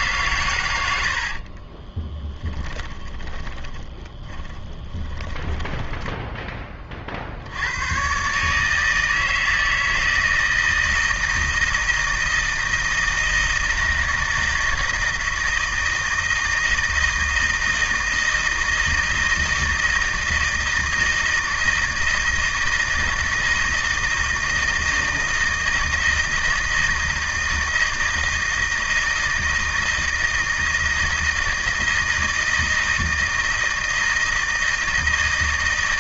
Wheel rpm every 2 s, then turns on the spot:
110, 20, 20, 20, 150, 160, 160, 160, 160, 160, 160, 160, 160, 160, 160, 160, 160, 160.
2-6